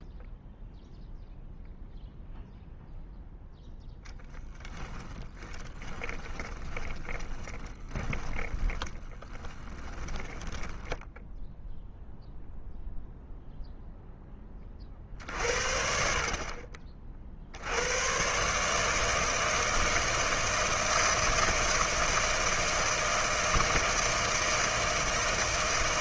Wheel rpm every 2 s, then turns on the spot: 0, 0, 10, 20, 10, 10, 0, 30, 40, 150, 160, 160, 160.
4-12